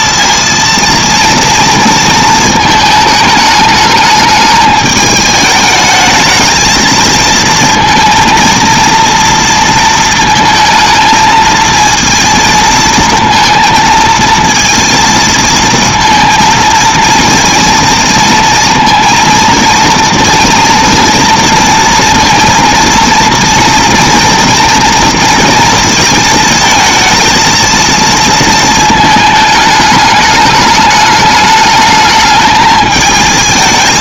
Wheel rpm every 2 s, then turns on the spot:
230, 220, 210, 220, 230, 220, 230, 230, 230, 230, 230, 230, 240, 220, 220, 210, 220.
none